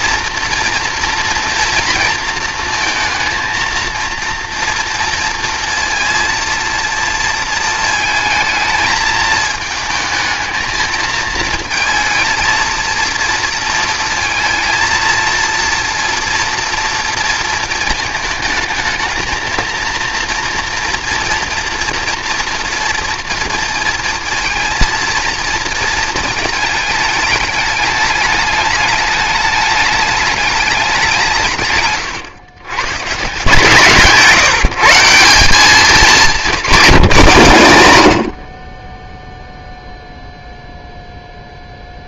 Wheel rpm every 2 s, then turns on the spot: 240, 230, 240, 230, 220, 220, 230, 230, 230, 220, 230, 240, 230, 220, 210, 210, 130, 150, 210, 40, 0.
none